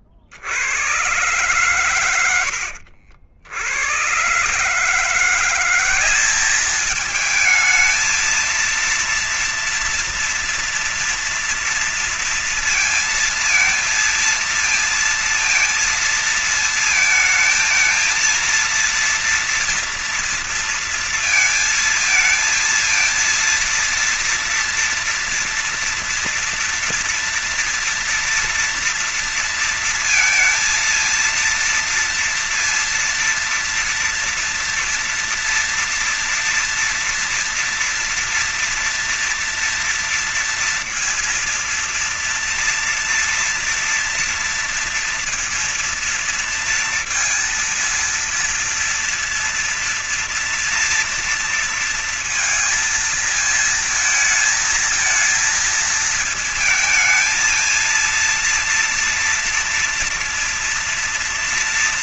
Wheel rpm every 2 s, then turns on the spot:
50, 110, 130, 200, 220, 240, 230, 230, 220, 220, 230, 220, 230, 240, 230, 230, 230, 230, 230, 230, 230, 230, 230, 230, 230, 230, 230, 220, 220, 230, 230.
none